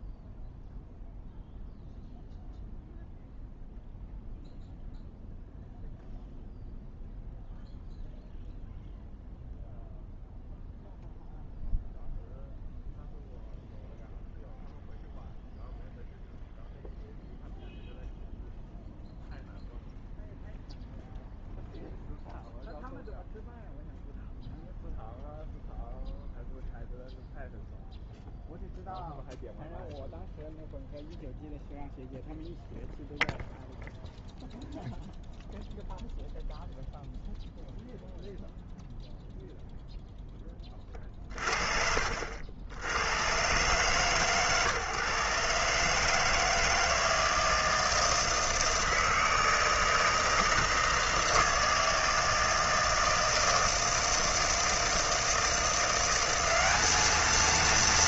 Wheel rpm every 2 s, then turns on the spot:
0, 0, 0, 0, 0, 0, 0, 0, 0, 0, 0, 0, 0, 0, 0, 0, 0, 0, 0, 0, 20, 90, 140, 160, 160, 160, 160, 160, 200.
none